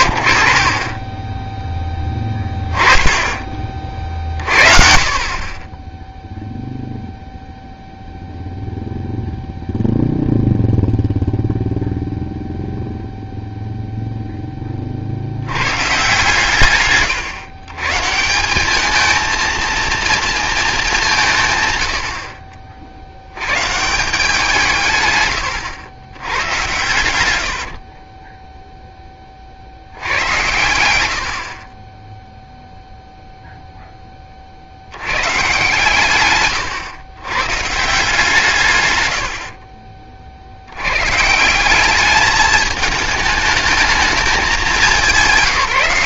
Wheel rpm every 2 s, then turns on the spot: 70, 10, 30, 0, 0, 0, 0, 20, 140, 200, 210, 60, 170, 100, 0, 110, 0, 60, 120, 130, 100, 220, 200.
36-38